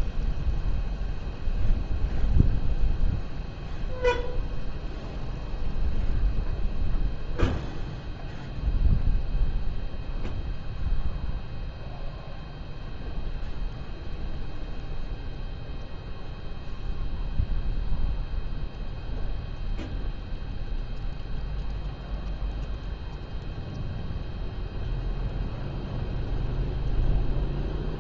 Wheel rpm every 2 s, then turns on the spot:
0, 0, 0, 0, 0, 0, 0, 0, 0, 0, 0, 0, 0, 0.
none